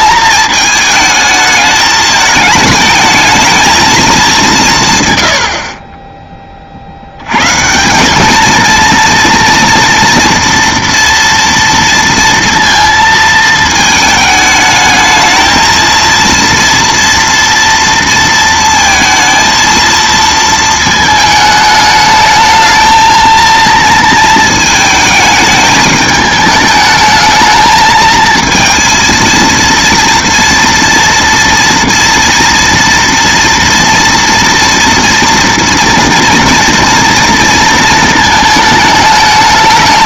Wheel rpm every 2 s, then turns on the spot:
220, 210, 170, 40, 220, 240, 230, 220, 230, 230, 220, 220, 220, 220, 230, 230, 230, 230, 230, 220.
none